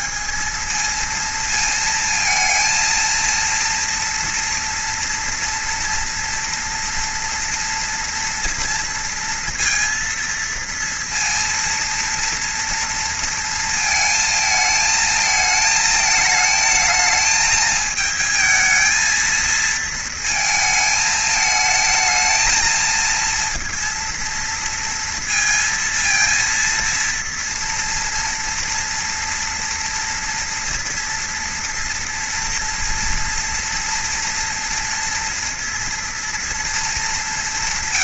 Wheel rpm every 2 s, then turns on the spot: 200, 230, 230, 230, 230, 230, 230, 220, 220, 220, 220, 220, 230, 230, 230, 230, 240, 230, 230.
none